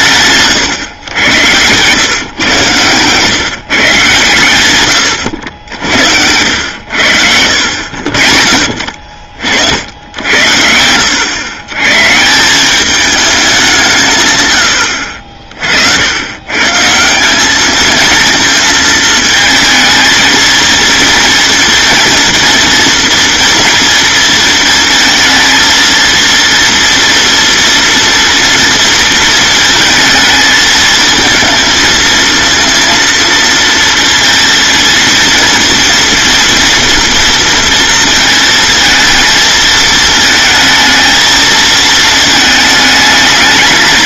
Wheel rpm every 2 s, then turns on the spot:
90, 130, 80, 80, 50, 100, 210, 50, 190, 220, 230, 230, 230, 230, 230, 230, 230, 230, 230, 230, 230, 220.
none